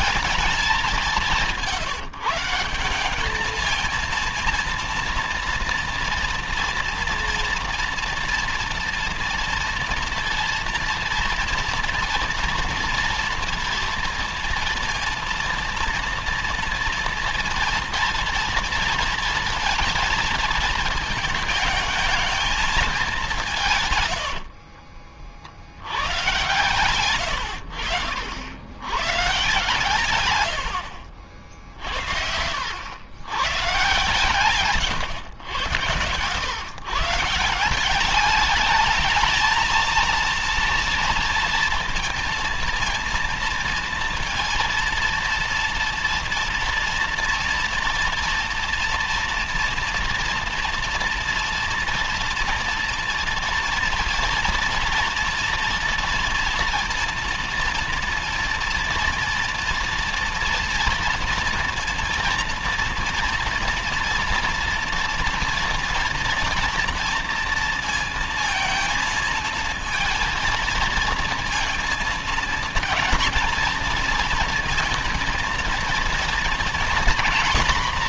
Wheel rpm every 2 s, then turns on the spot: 200, 180, 230, 230, 240, 230, 230, 230, 230, 230, 220, 210, 50, 130, 100, 70, 80, 130, 120, 210, 230, 230, 230, 230, 230, 230, 230, 230, 230, 240, 230, 230, 230, 230, 230, 230, 220, 230, 230.
24-26 30-32 34-36